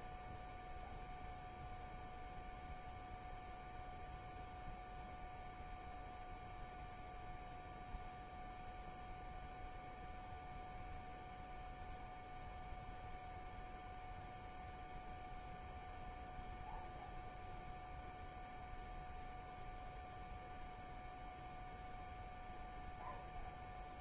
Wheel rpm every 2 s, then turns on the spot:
0, 0, 0, 0, 0, 0, 0, 0, 0, 0, 0, 0.
none